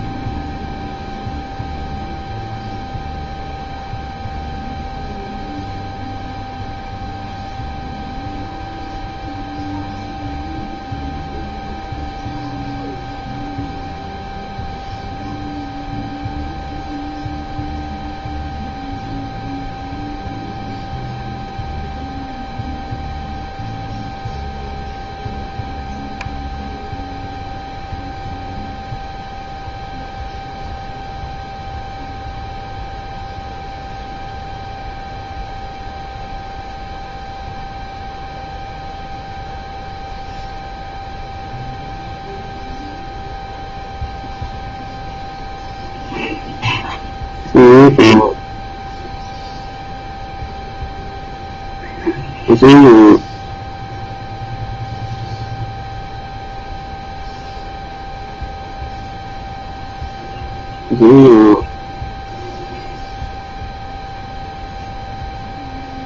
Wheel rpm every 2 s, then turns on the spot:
0, 0, 0, 0, 0, 0, 0, 0, 0, 0, 0, 0, 0, 0, 0, 0, 0, 0, 0, 0, 0, 0, 0, 0, 0, 0, 0, 0, 0, 0, 0, 0, 0.
none